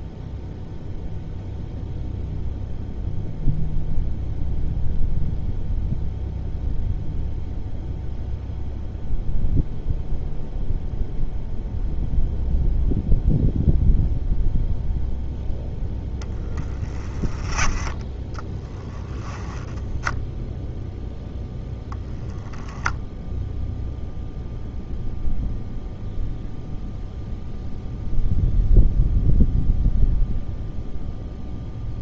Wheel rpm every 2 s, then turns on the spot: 0, 0, 0, 0, 0, 0, 0, 0, 10, 10, 0, 0, 0, 0, 0, 0.
none